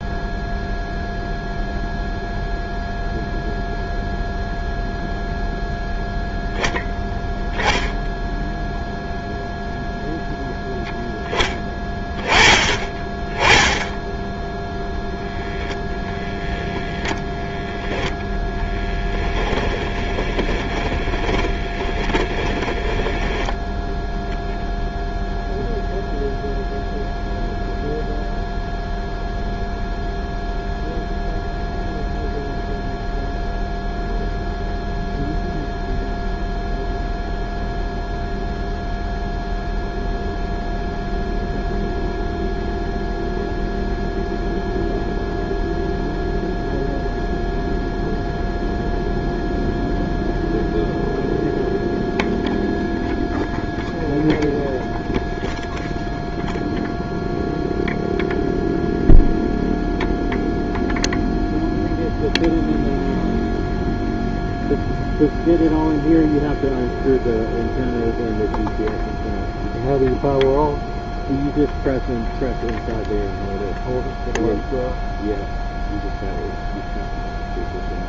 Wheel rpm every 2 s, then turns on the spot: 0, 0, 0, 0, 0, 10, 20, 0, 10, 10, 20, 10, 0, 0, 0, 0, 0, 0, 0, 0, 0, 0, 0, 0, 0, 0, 0, 0, 0, 0, 0, 0, 0, 0, 0, 0, 0, 0, 0.
18-22